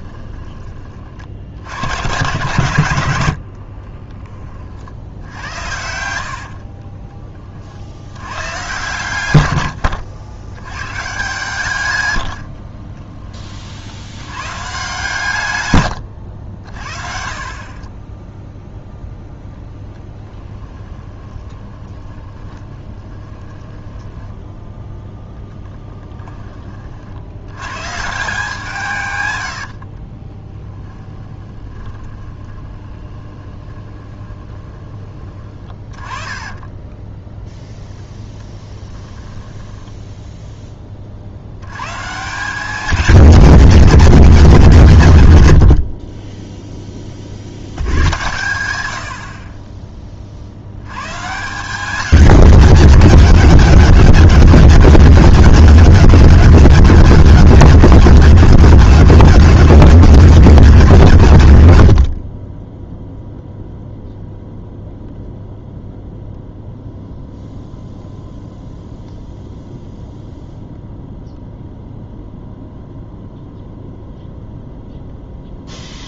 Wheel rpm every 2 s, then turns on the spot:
30, 110, 40, 40, 120, 120, 30, 130, 50, 0, 20, 20, 0, 40, 160, 10, 20, 20, 10, 20, 10, 190, 140, 10, 100, 90, 170, 160, 160, 160, 160, 10, 0, 0, 0, 0, 0, 0.
6-8 12-14 20-24 30-34 36-40 62-64